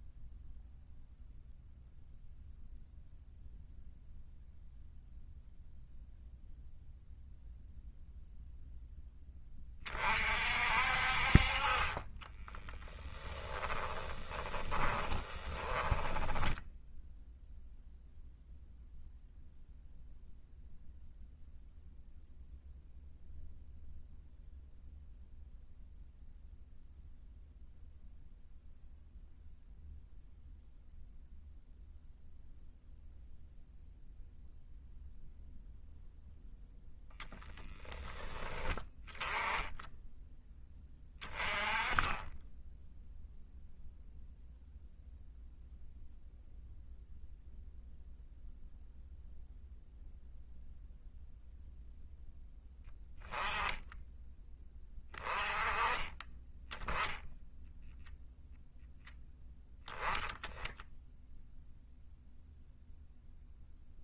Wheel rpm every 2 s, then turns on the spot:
0, 0, 0, 0, 0, 50, 10, 20, 10, 0, 0, 0, 0, 0, 0, 0, 0, 0, 10, 10, 20, 10, 0, 0, 0, 0, 10, 20, 30, 0, 10, 0.
12-18